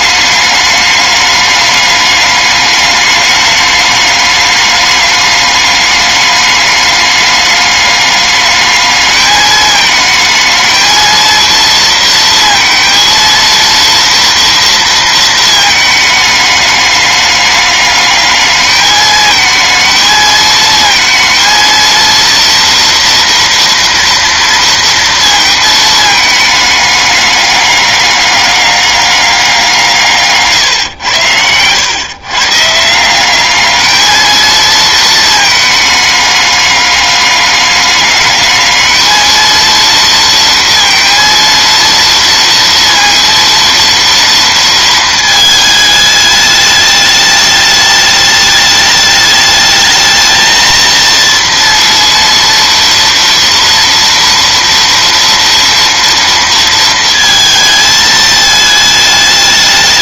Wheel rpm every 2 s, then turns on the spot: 210, 210, 200, 210, 210, 220, 230, 230, 210, 210, 220, 230, 230, 210, 200, 130, 150, 220, 210, 210, 230, 230, 230, 210, 210, 230, 230, 230, 230, 220.
none